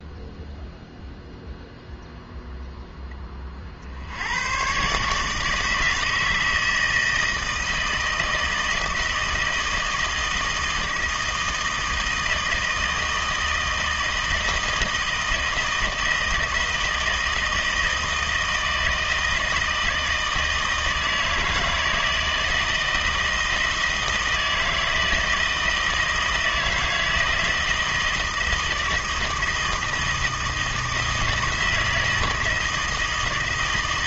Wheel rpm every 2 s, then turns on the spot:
0, 0, 120, 160, 160, 160, 160, 160, 160, 160, 160, 160, 160, 160, 160, 160, 160.
none